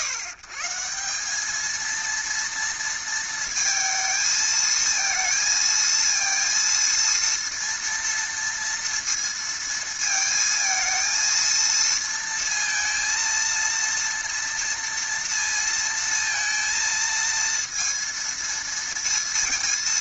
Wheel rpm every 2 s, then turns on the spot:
140, 230, 220, 230, 230, 220, 230, 230, 230, 230.
none